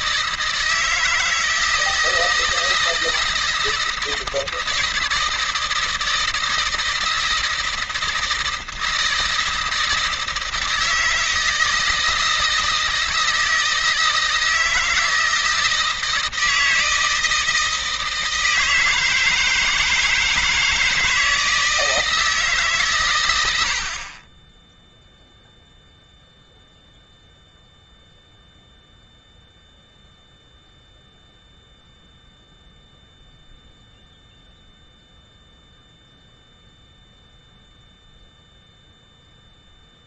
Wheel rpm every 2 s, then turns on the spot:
160, 160, 160, 160, 160, 160, 160, 160, 160, 160, 160, 150, 30, 0, 0, 0, 0, 0, 0, 0.
none